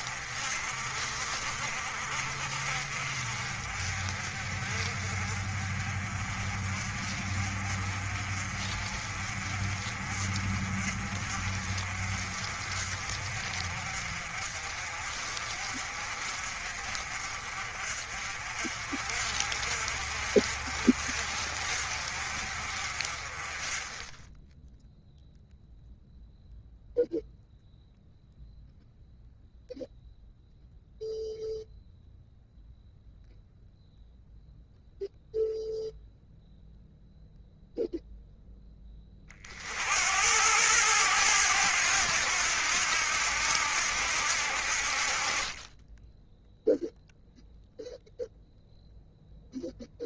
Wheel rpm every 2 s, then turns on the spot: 50, 40, 40, 40, 40, 40, 40, 40, 40, 50, 50, 40, 0, 0, 0, 0, 0, 0, 0, 20, 100, 80, 50, 0, 0.
none